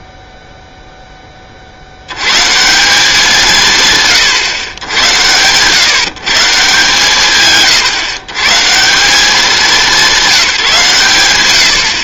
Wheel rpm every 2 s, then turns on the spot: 0, 190, 120, 130, 180, 160.
none